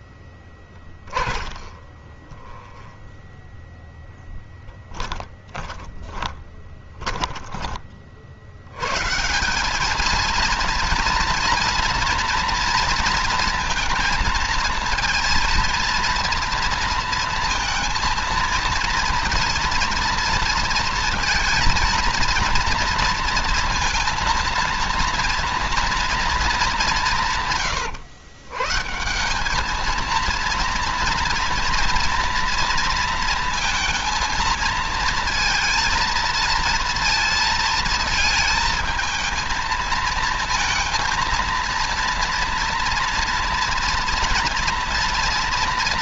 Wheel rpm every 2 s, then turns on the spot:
20, 10, 10, 10, 130, 240, 230, 220, 230, 230, 230, 230, 230, 180, 150, 240, 230, 230, 230, 220, 230, 230, 230.
0-8